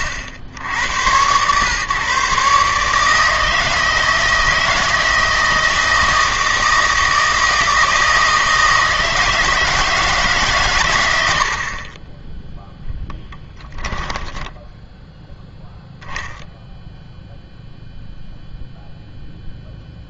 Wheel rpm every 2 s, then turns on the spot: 70, 150, 160, 160, 160, 120, 10, 10, 0, 0.
none